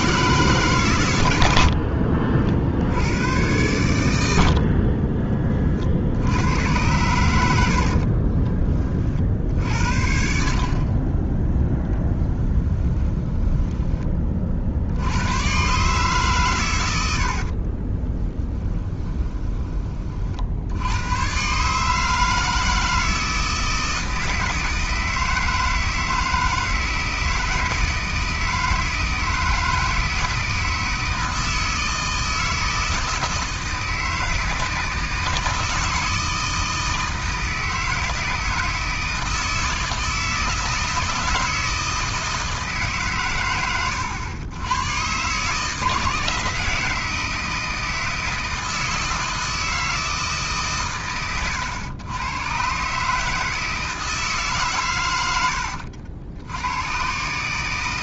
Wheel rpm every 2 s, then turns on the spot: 140, 60, 60, 100, 30, 40, 10, 60, 110, 20, 80, 160, 160, 160, 160, 160, 160, 160, 160, 160, 160, 160, 110, 160, 160, 130, 120, 130, 100.
12-14 18-20